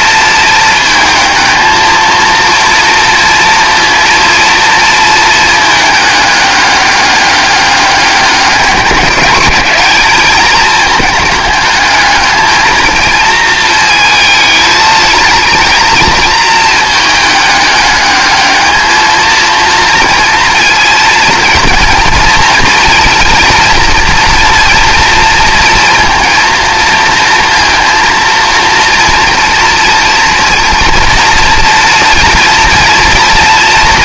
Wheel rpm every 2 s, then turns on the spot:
230, 230, 230, 200, 200, 220, 220, 220, 220, 210, 230, 230, 230, 230, 230, 230, 230.
none